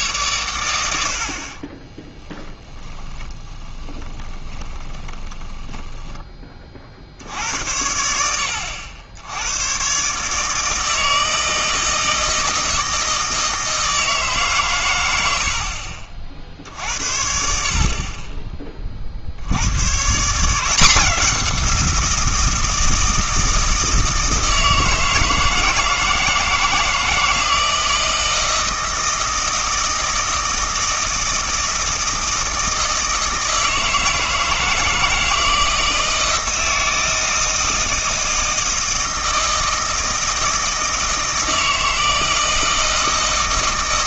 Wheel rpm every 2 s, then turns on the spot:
100, 30, 20, 40, 80, 160, 160, 120, 70, 40, 180, 170, 160, 160, 160, 160, 160, 160, 160, 160, 160, 160.
2-6